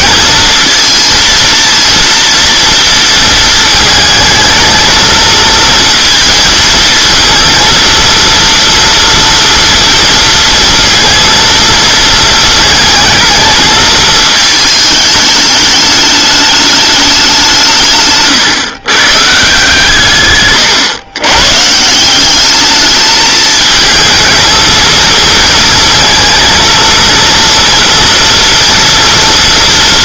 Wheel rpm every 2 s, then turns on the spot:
230, 230, 220, 230, 230, 230, 220, 220, 210, 130, 130, 210, 230, 220, 230.
none